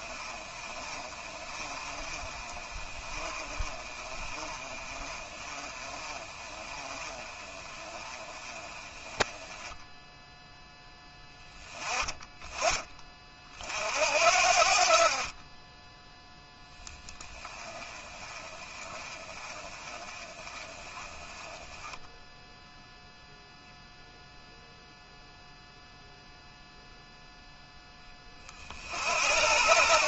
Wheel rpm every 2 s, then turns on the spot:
30, 30, 30, 30, 20, 10, 30, 50, 10, 20, 20, 0, 0, 0, 70.
none